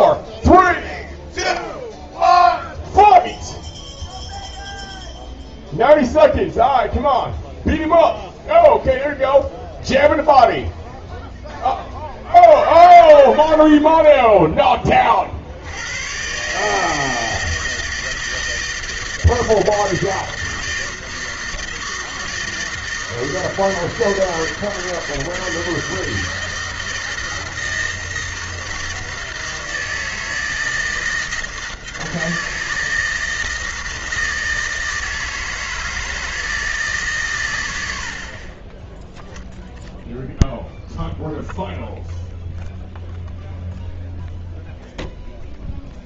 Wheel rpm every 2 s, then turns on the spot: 0, 0, 0, 0, 0, 0, 10, 10, 140, 160, 160, 160, 160, 160, 160, 160, 160, 160, 160, 20, 0, 0, 0.
12-14